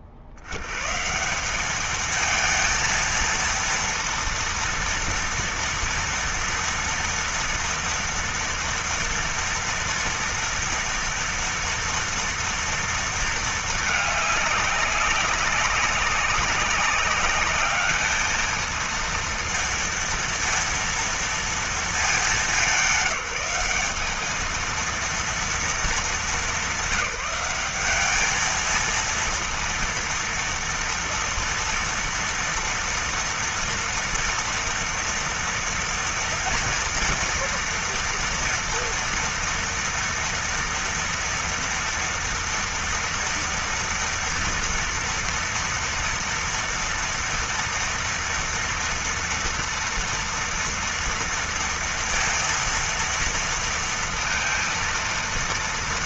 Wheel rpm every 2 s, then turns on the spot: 60, 220, 230, 230, 230, 230, 230, 200, 190, 220, 230, 210, 220, 190, 220, 230, 230, 230, 230, 230, 230, 230, 230, 230, 230, 230, 230, 230.
none